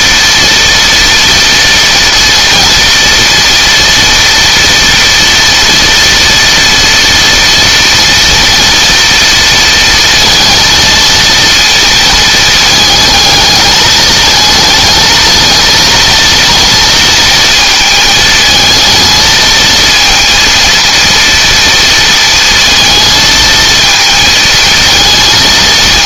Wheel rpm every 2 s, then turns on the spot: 230, 240, 230, 230, 230, 230, 220, 220, 230, 220, 230, 230, 220.
none